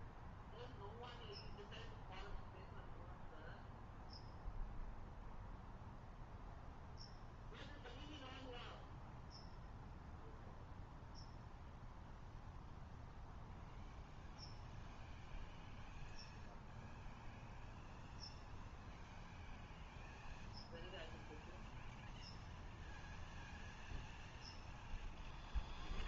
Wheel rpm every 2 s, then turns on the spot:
0, 0, 0, 0, 0, 0, 0, 0, 0, 0, 0, 0, 0.
none